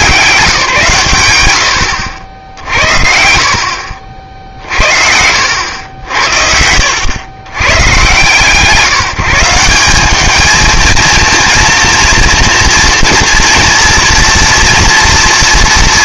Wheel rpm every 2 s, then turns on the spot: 150, 70, 60, 80, 160, 220, 230, 230.
2-6